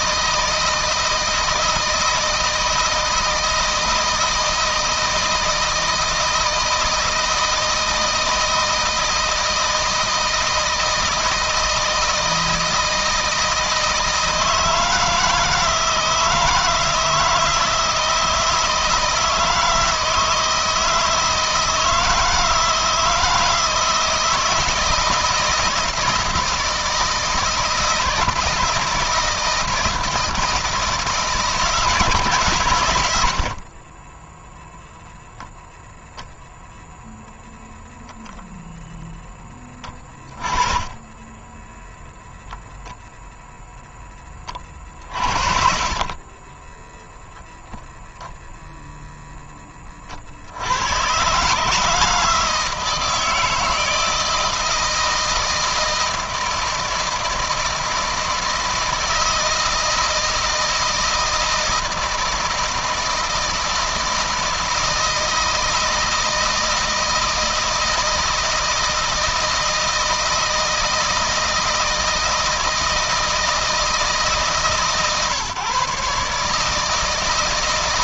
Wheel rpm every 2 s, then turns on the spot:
160, 160, 160, 160, 160, 160, 160, 160, 160, 160, 160, 160, 160, 160, 160, 160, 110, 0, 0, 0, 20, 0, 50, 10, 0, 100, 160, 160, 160, 160, 160, 160, 160, 160, 160, 160, 160, 140, 160.
46-48